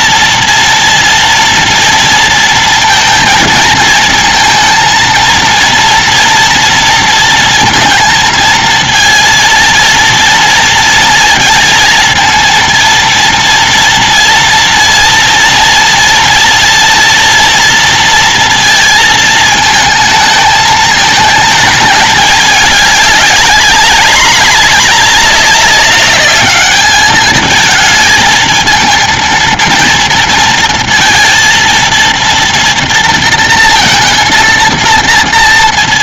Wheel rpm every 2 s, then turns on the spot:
230, 230, 230, 230, 230, 230, 220, 230, 230, 230, 220, 220, 210, 210, 220, 230, 230, 230.
none